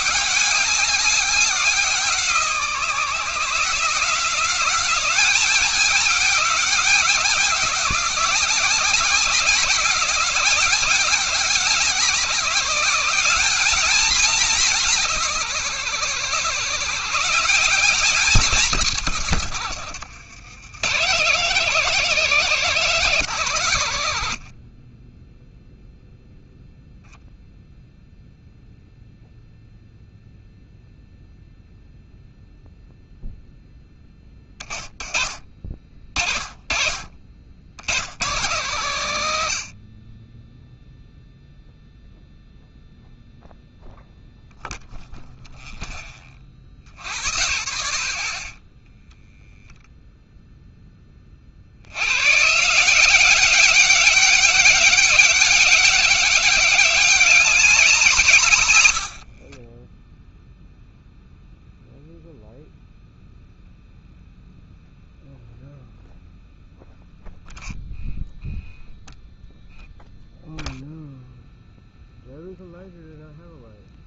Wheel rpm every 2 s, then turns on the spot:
200, 160, 180, 200, 190, 190, 190, 200, 140, 170, 130, 210, 80, 0, 0, 0, 0, 20, 40, 100, 20, 0, 0, 20, 30, 10, 140, 200, 200, 130, 0, 0, 0, 0, 0, 0, 0.
48-50 58-60